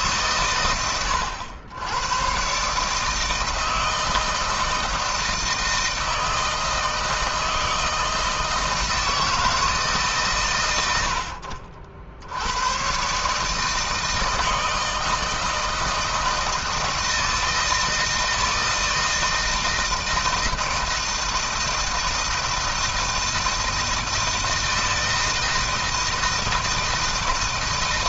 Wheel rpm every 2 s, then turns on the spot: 100, 150, 160, 160, 160, 100, 110, 160, 160, 160, 160, 160, 160, 160.
none